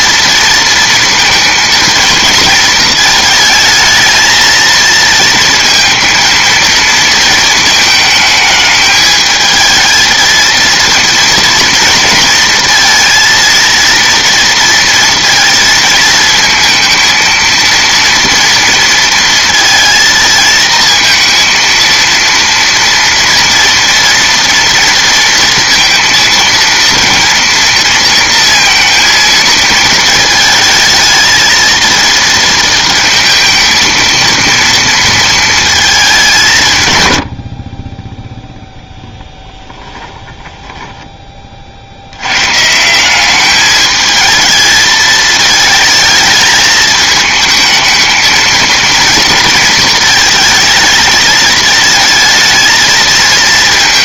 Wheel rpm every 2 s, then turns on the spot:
230, 220, 230, 230, 220, 230, 230, 230, 220, 230, 230, 230, 230, 230, 230, 220, 230, 230, 140, 0, 10, 140, 220, 220, 230, 220, 230.
40-42